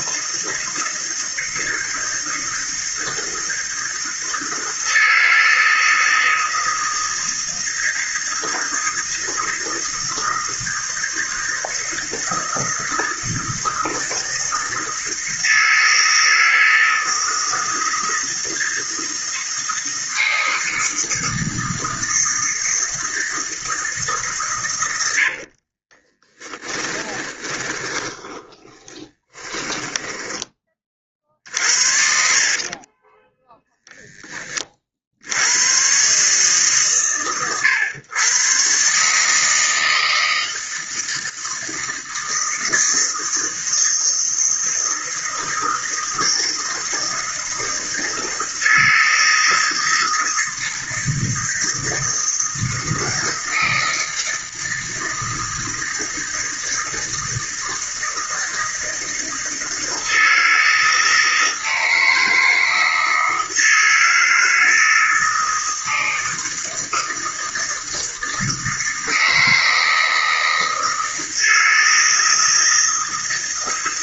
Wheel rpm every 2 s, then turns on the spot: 160, 160, 160, 160, 160, 160, 160, 160, 160, 160, 160, 160, 100, 30, 20, 40, 30, 30, 140, 130, 160, 160, 160, 160, 160, 160, 160, 160, 160, 160, 160, 160, 160, 160, 160, 160, 160.
26-30 32-34